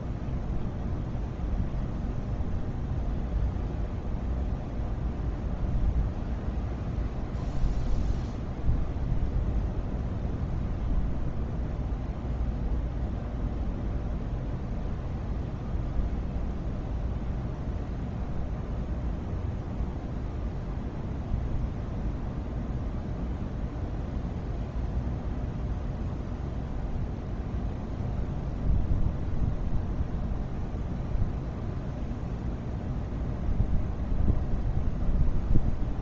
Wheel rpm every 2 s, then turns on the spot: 0, 0, 0, 0, 0, 0, 0, 0, 0, 0, 0, 0, 0, 0, 0, 0, 0, 0.
none